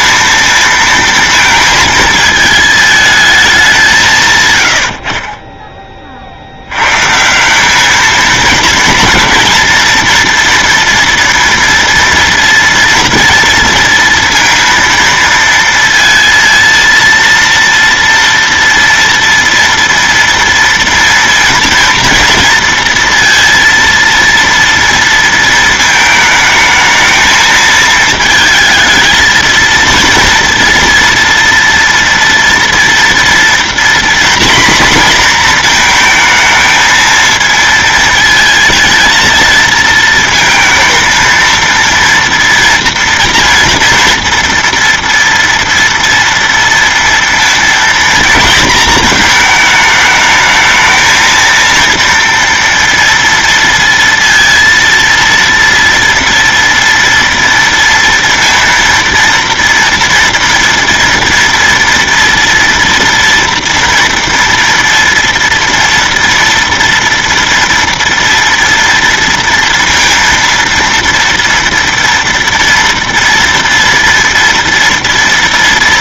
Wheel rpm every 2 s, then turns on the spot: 230, 220, 160, 50, 220, 230, 230, 230, 230, 230, 230, 230, 230, 220, 220, 230, 230, 240, 220, 230, 230, 230, 230, 230, 230, 220, 230, 230, 230, 230, 230, 240, 230, 230, 230, 230, 230, 230.
none